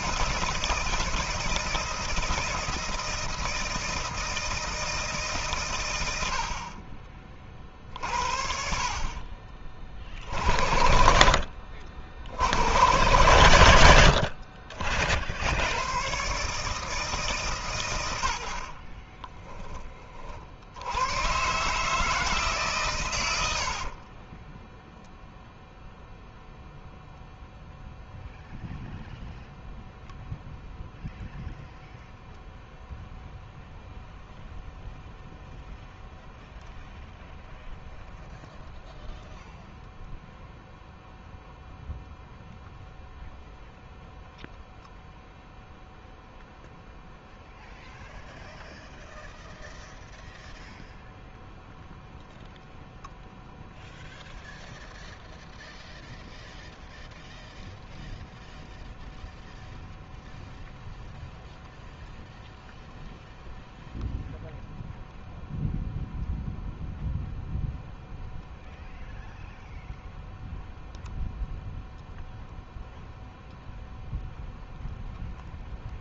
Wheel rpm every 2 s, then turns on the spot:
160, 160, 160, 40, 60, 70, 110, 40, 150, 40, 80, 130, 0, 0, 0, 0, 0, 0, 0, 0, 0, 0, 0, 0, 0, 0, 0, 0, 0, 0, 0, 0, 0, 0, 0, 0, 0, 0.
8-10 18-20